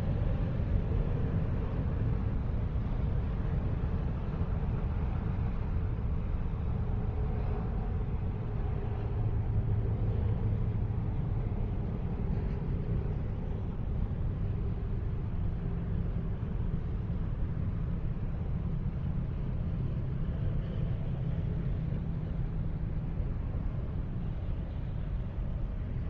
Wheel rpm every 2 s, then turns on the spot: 0, 0, 0, 0, 0, 0, 0, 0, 0, 0, 0, 0, 0.
none